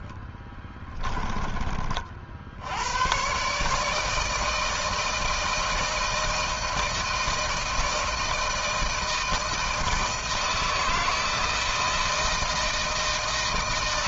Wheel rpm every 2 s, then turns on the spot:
20, 100, 160, 160, 160, 160, 160.
0-2